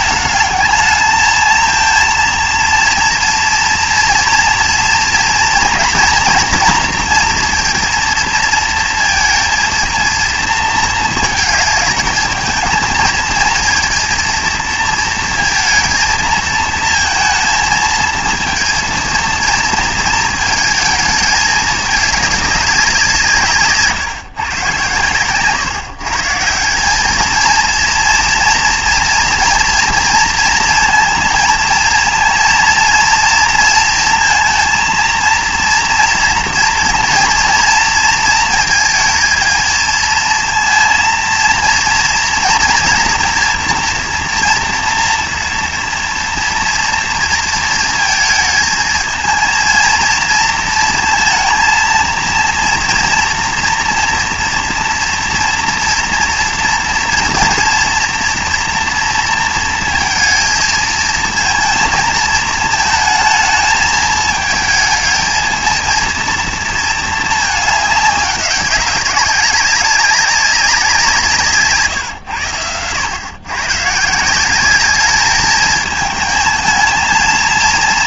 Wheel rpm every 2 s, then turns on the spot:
220, 230, 240, 240, 230, 220, 220, 230, 230, 230, 220, 190, 130, 190, 230, 230, 230, 230, 230, 230, 230, 230, 230, 230, 220, 230, 230, 230, 230, 230, 230, 220, 220, 230, 190, 180, 100, 210, 220.
none